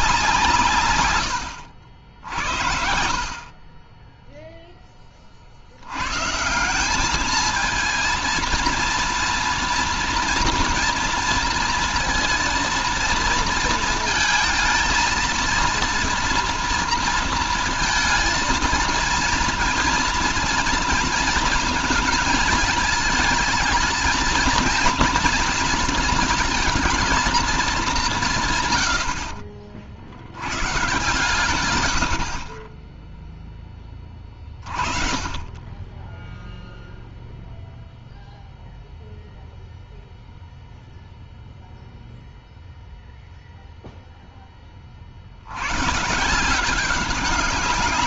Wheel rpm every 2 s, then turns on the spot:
130, 60, 10, 180, 230, 240, 230, 220, 230, 230, 230, 220, 230, 230, 110, 130, 20, 30, 0, 0, 0, 0, 30, 180.
none